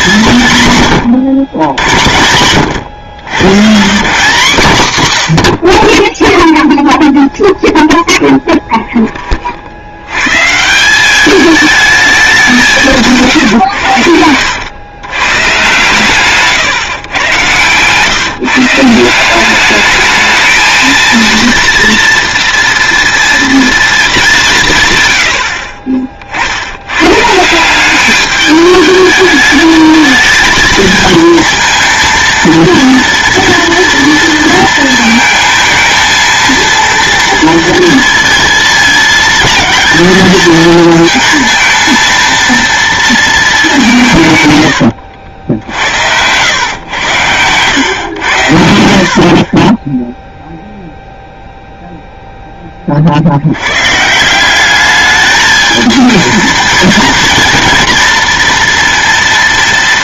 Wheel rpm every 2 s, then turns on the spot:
130, 90, 150, 0, 0, 160, 180, 100, 130, 160, 220, 240, 160, 90, 210, 220, 230, 230, 230, 220, 220, 230, 100, 100, 70, 0, 20, 200, 230, 230.
24-26 44-46